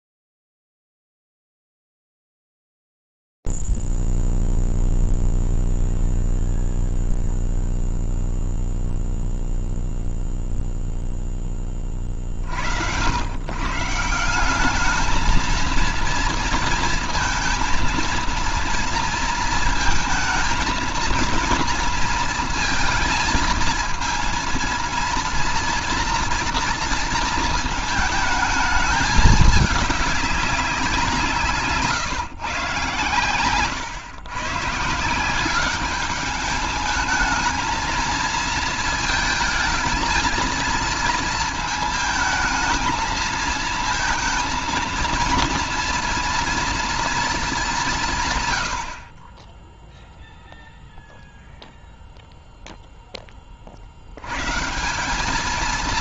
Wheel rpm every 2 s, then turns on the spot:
0, 0, 0, 0, 0, 0, 50, 180, 230, 230, 230, 230, 230, 230, 220, 180, 130, 150, 220, 230, 230, 220, 230, 230, 70, 0, 10, 180.
none